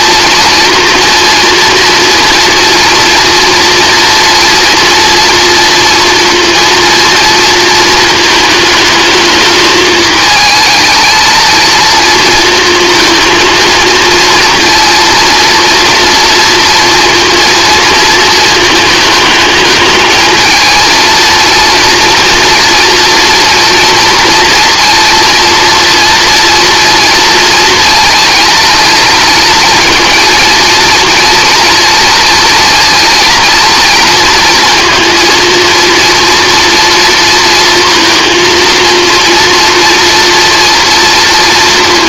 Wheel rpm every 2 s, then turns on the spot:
230, 230, 230, 230, 220, 220, 230, 230, 230, 220, 230, 230, 230, 230, 230, 230, 230, 230, 230, 230, 230.
none